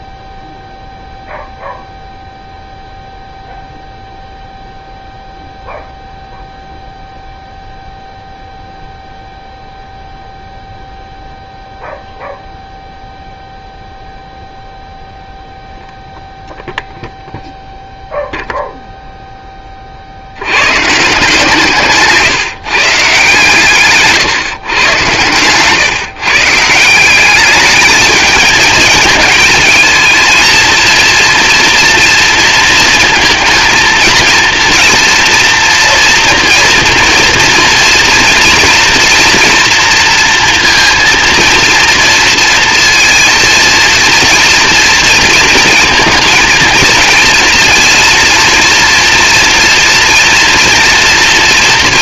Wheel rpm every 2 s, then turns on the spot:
0, 0, 0, 0, 0, 0, 0, 0, 0, 0, 120, 140, 130, 170, 220, 230, 230, 230, 230, 230, 230, 230, 230, 240, 230, 240.
none